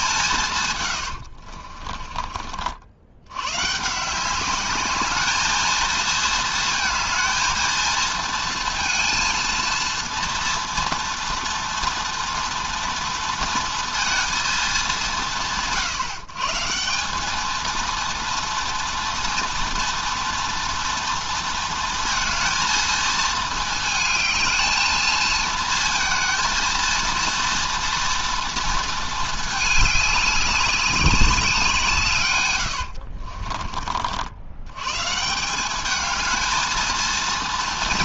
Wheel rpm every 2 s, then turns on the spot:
140, 60, 200, 220, 230, 230, 230, 190, 160, 230, 230, 220, 220, 230, 230, 200, 100, 90, 220.
32-34